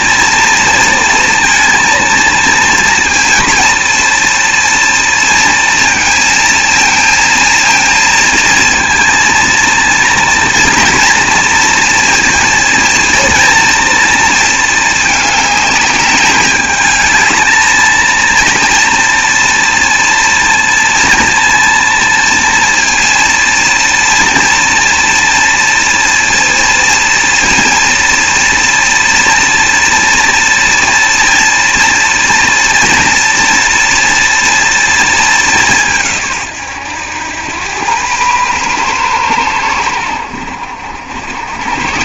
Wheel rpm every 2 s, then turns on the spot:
230, 230, 230, 230, 230, 230, 230, 220, 210, 230, 230, 230, 230, 230, 230, 230, 230, 230, 110, 120, 70.
none